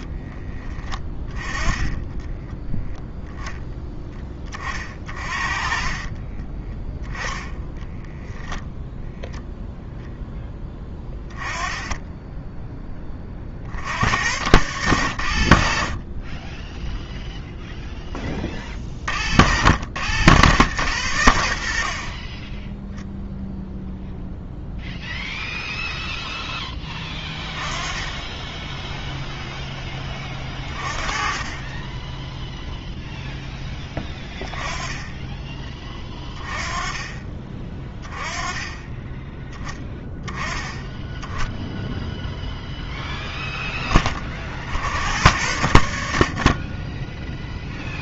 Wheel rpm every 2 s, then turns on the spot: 20, 10, 30, 10, 0, 10, 10, 90, 0, 40, 100, 0, 0, 10, 0, 30, 0, 10, 20, 10, 10, 0, 70, 10.
6-8 10-12 30-32